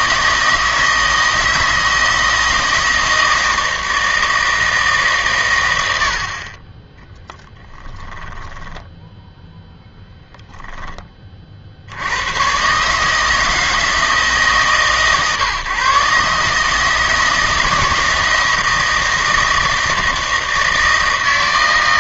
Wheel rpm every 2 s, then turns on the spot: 160, 160, 150, 20, 10, 10, 150, 140, 150, 160, 160.
8-10